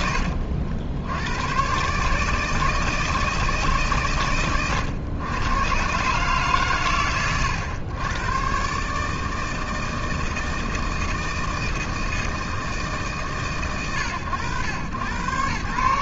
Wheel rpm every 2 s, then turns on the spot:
80, 160, 100, 90, 160, 160, 150, 100.
none